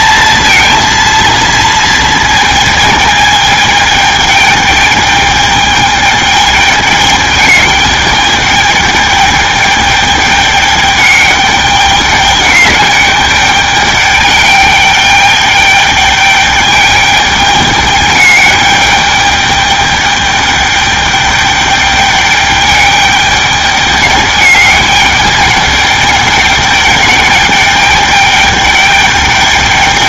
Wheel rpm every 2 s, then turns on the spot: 230, 220, 210, 210, 210, 210, 210, 210, 210, 210, 210, 210, 210, 210, 210.
none